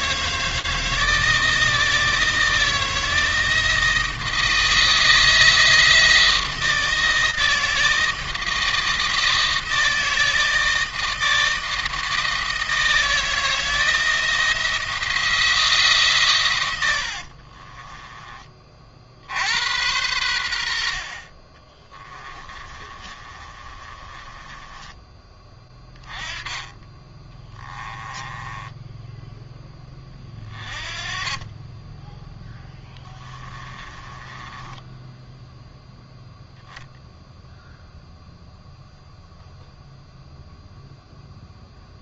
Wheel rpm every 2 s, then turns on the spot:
160, 160, 160, 160, 160, 160, 160, 170, 90, 50, 60, 30, 20, 20, 10, 20, 10, 10, 0, 0, 0.
16-18 22-24 28-30 32-36